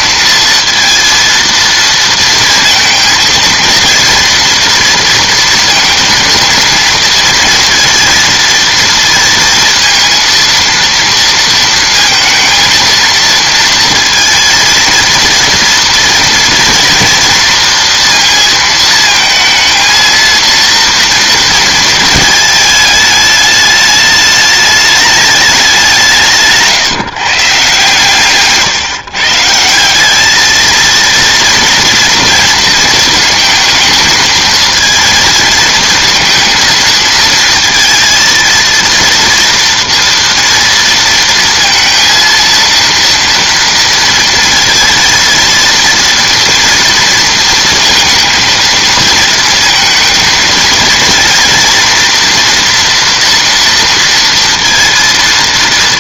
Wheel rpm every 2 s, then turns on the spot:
230, 230, 240, 230, 230, 230, 230, 230, 240, 230, 230, 220, 210, 160, 150, 220, 230, 220, 230, 230, 230, 230, 230, 230, 220, 230, 240, 230.
none